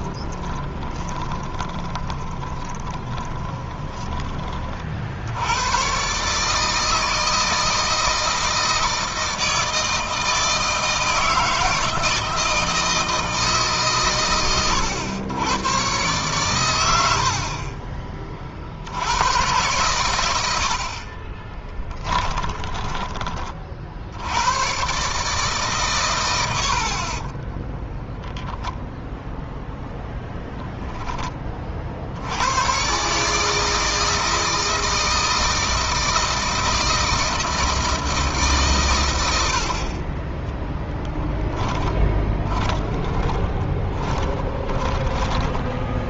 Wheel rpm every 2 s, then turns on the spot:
20, 20, 40, 150, 160, 160, 160, 90, 110, 60, 70, 20, 110, 80, 0, 10, 110, 160, 160, 140, 10, 20, 20.
0-4 22-24 40-46